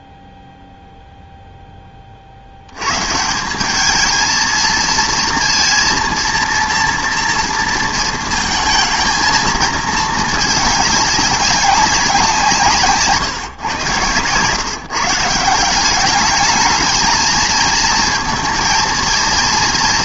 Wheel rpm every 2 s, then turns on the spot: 0, 80, 230, 230, 220, 210, 170, 130, 210, 230.
none